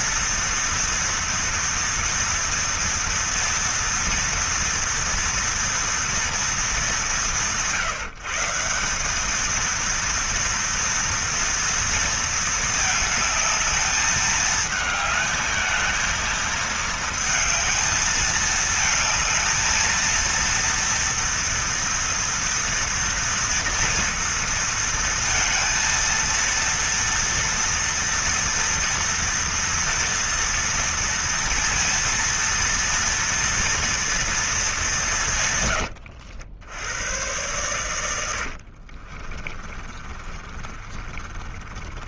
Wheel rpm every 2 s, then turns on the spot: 230, 230, 230, 200, 180, 230, 220, 220, 220, 220, 230, 230, 230, 230, 230, 230, 230, 200, 100, 40, 30.
38-42